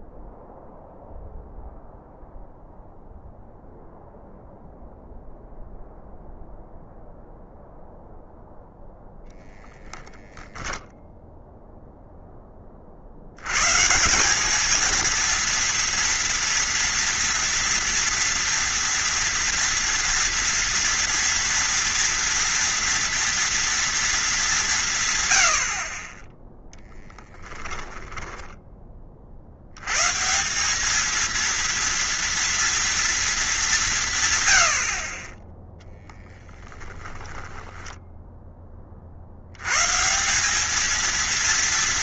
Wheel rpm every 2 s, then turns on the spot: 0, 0, 0, 0, 0, 0, 30, 210, 230, 230, 230, 230, 170, 10, 10, 200, 230, 90, 10, 30, 210.
26-28 36-38